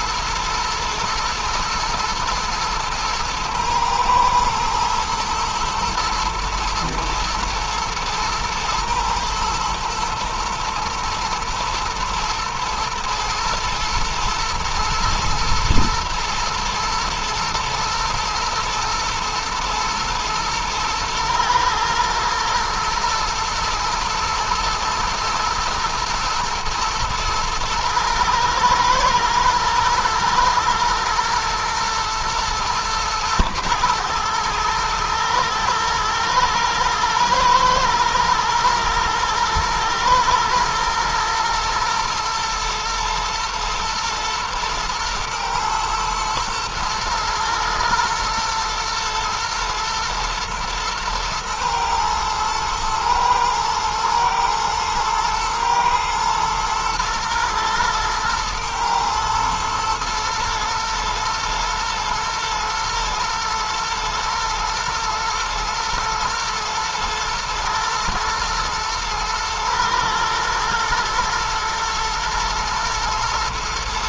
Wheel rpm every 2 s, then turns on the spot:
110, 110, 110, 110, 110, 120, 120, 120, 120, 110, 110, 120, 110, 110, 110, 120, 120, 110, 120, 110, 120, 110, 110, 110, 110, 110, 110, 110, 120, 120, 110, 120, 120, 120, 110, 110, 110.
none